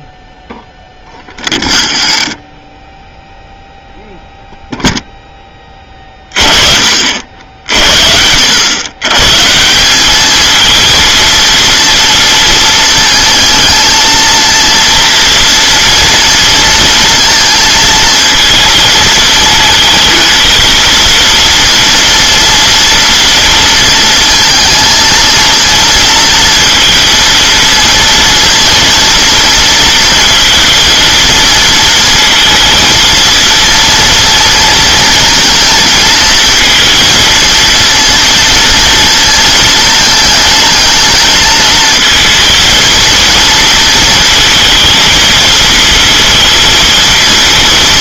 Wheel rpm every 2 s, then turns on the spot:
0, 0, 0, 50, 120, 230, 220, 230, 230, 230, 230, 230, 230, 230, 230, 230, 230, 230, 230, 230, 220, 230, 220, 230.
none